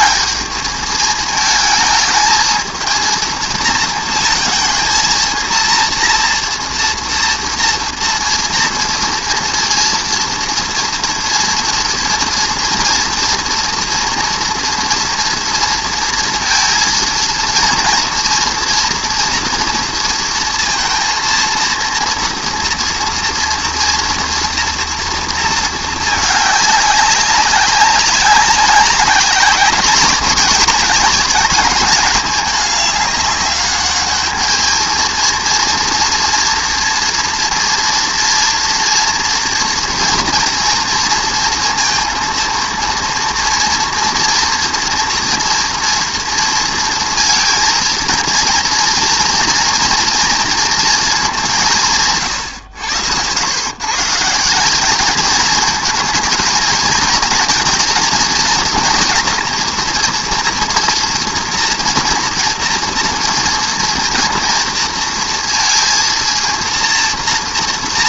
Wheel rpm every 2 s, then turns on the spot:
210, 220, 230, 240, 230, 230, 240, 230, 230, 230, 230, 240, 230, 200, 200, 200, 200, 220, 230, 230, 230, 230, 230, 230, 230, 230, 90, 190, 220, 230, 240, 230, 230, 230.
none